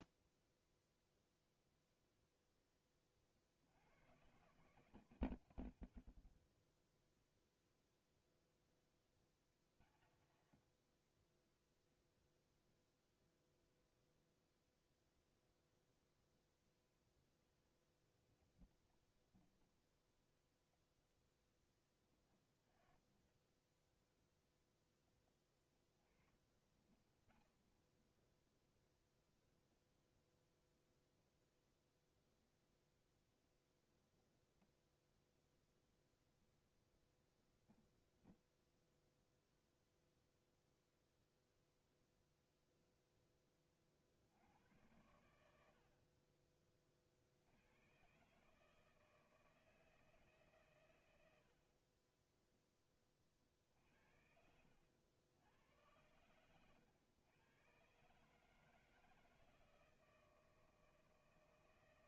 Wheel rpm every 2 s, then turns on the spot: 0, 0, 160, 30, 0, 70, 0, 0, 0, 0, 0, 10, 0, 30, 0, 0, 0, 0, 0, 0, 0, 0, 80, 30, 150, 150, 10, 80, 110, 160, 160.
10-12 26-28 54-56